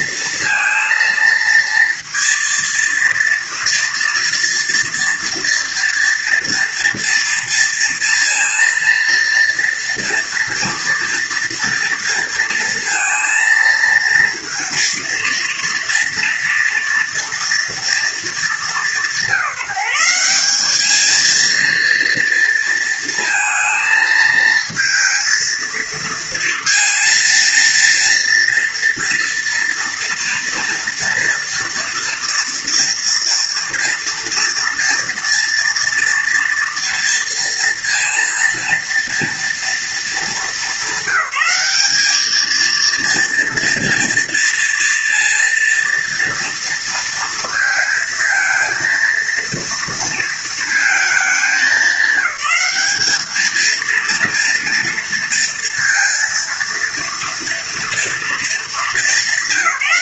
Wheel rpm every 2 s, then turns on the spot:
230, 230, 230, 230, 230, 230, 230, 230, 230, 190, 220, 230, 220, 230, 230, 230, 230, 230, 230, 230, 200, 230, 230, 230, 230, 230, 210, 230, 230, 220.
none